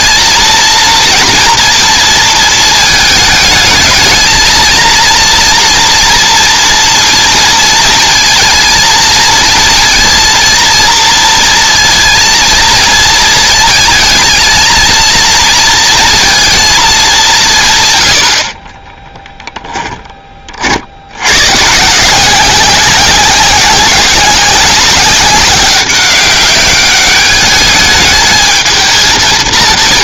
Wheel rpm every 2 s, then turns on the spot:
230, 220, 220, 230, 230, 230, 230, 230, 230, 60, 40, 190, 190, 200, 220.
none